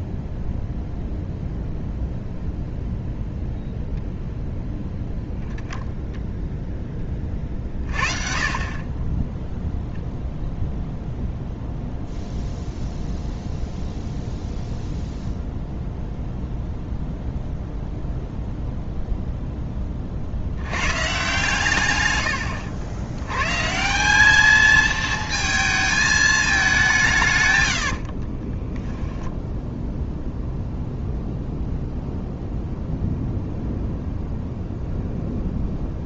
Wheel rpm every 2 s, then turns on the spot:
0, 0, 0, 10, 30, 0, 0, 0, 0, 0, 90, 90, 210, 200, 20, 0, 0, 0.
22-24 28-30